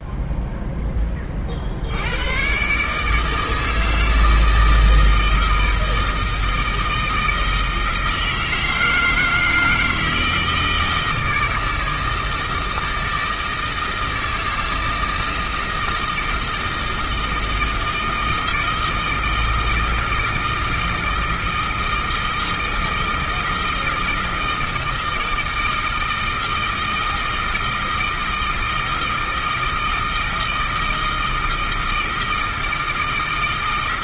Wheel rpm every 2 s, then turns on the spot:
10, 140, 160, 160, 160, 160, 160, 160, 160, 160, 160, 160, 160, 160, 160, 160, 160.
none